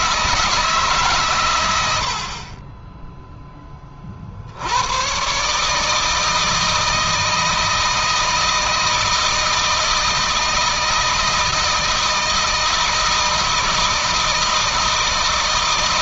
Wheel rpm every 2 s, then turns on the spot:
130, 10, 130, 160, 160, 160, 160, 160.
none